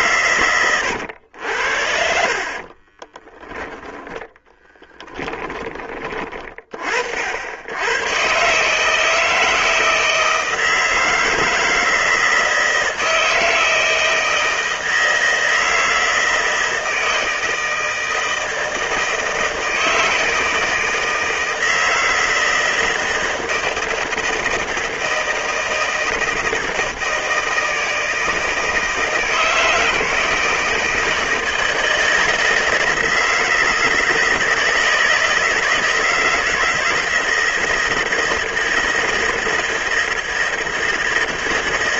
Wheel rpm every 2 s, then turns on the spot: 90, 30, 10, 50, 150, 160, 160, 160, 160, 160, 160, 160, 160, 160, 160, 160, 160, 160, 160, 160, 160.
2-6